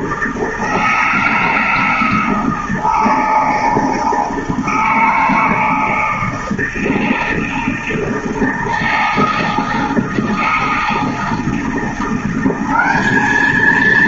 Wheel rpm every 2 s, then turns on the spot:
160, 160, 160, 160, 160, 160, 200.
none